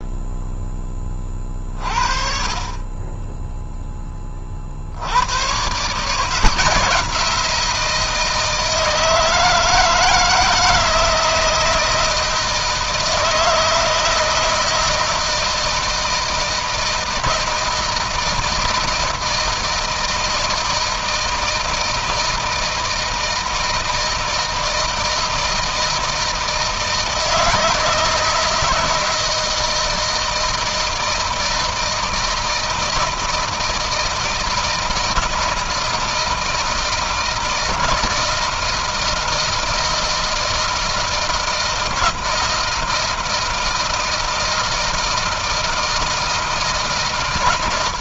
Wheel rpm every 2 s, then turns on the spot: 10, 40, 50, 170, 160, 160, 160, 170, 160, 160, 160, 160, 160, 160, 160, 160, 160, 160, 160, 160, 160, 160, 160, 160.
2-4